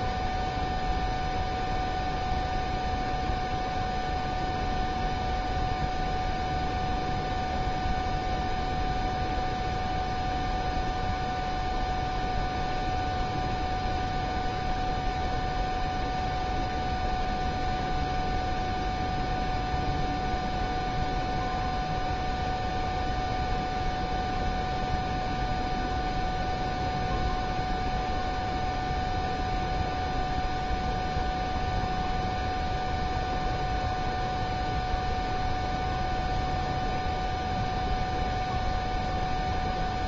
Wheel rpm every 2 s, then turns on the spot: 0, 0, 0, 0, 0, 0, 0, 0, 0, 0, 0, 0, 0, 0, 0, 0, 0, 0, 0, 0.
none